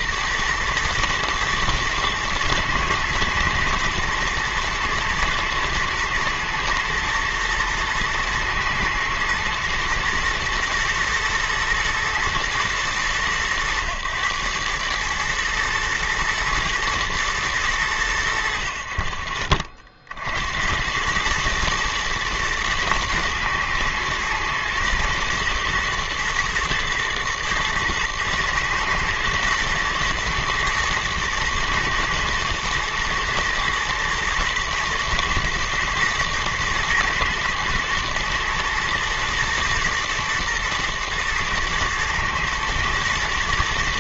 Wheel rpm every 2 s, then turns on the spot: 120, 120, 110, 120, 110, 120, 110, 110, 120, 60, 70, 110, 120, 110, 110, 120, 110, 110, 120, 110, 120, 110.
none